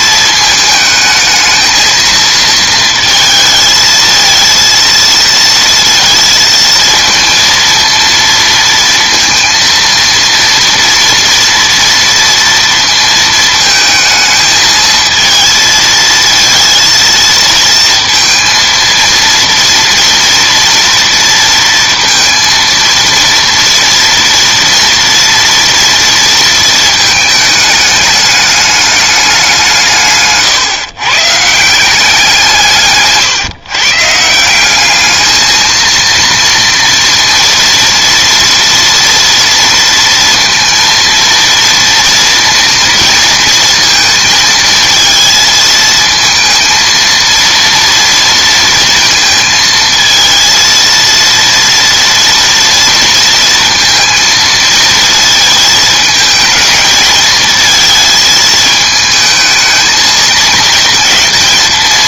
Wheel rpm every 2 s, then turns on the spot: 220, 220, 230, 230, 230, 230, 230, 220, 230, 230, 230, 230, 230, 220, 210, 140, 150, 190, 230, 230, 230, 230, 220, 230, 230, 230, 230, 230, 220, 220, 230.
none